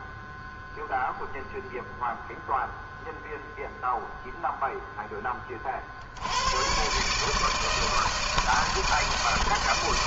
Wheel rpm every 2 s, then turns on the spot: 0, 0, 0, 90, 160.
none